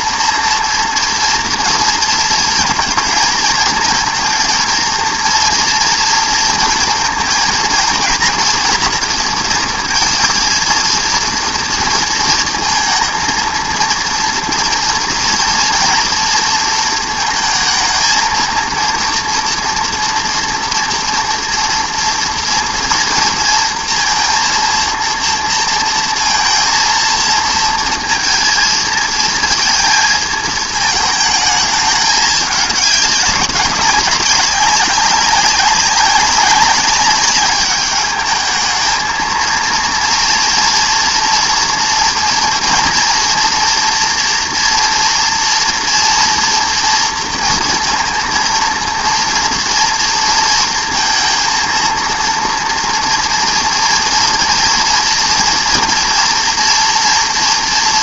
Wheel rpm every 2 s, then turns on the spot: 230, 230, 230, 230, 240, 230, 230, 230, 230, 230, 230, 230, 230, 230, 230, 220, 210, 200, 190, 220, 240, 240, 230, 230, 230, 230, 230, 230, 230.
none